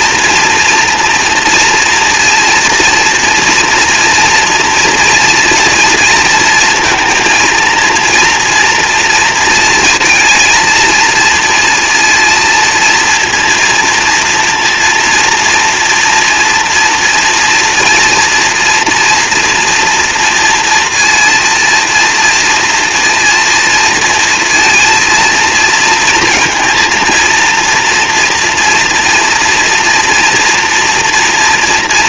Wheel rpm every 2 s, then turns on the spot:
230, 230, 230, 230, 230, 220, 230, 230, 230, 230, 230, 230, 230, 230, 230, 230.
none